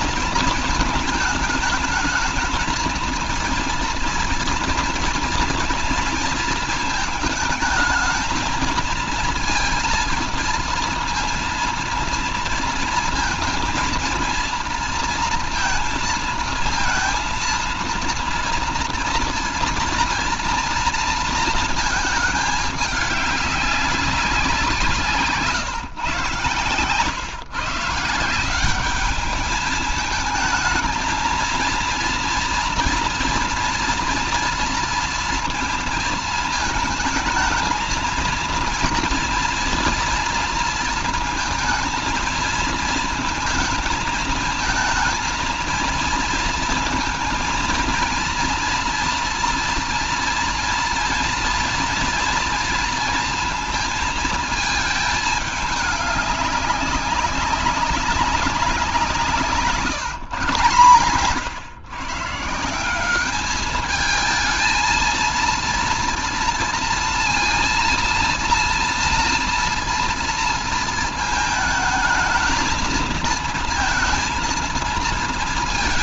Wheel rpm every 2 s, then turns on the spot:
230, 220, 230, 220, 230, 230, 230, 230, 230, 230, 240, 210, 180, 130, 190, 220, 240, 230, 220, 230, 230, 230, 230, 230, 230, 230, 230, 220, 200, 180, 130, 170, 220, 230, 230, 230, 220, 220.
none